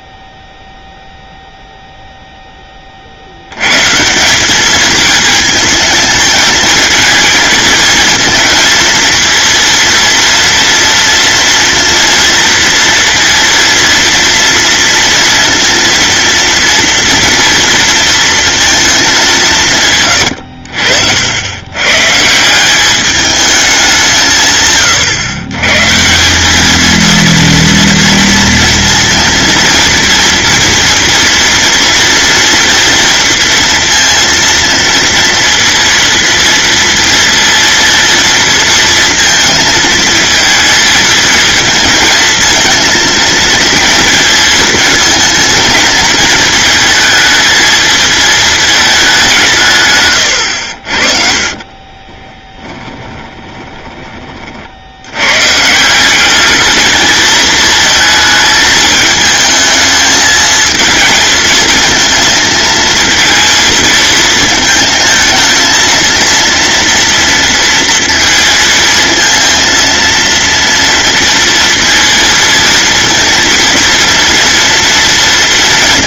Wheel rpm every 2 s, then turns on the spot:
0, 30, 210, 220, 230, 230, 230, 230, 230, 210, 60, 190, 130, 220, 230, 230, 230, 230, 230, 230, 220, 230, 220, 220, 210, 60, 10, 80, 210, 220, 220, 230, 220, 230, 230, 230, 230, 230.
52-54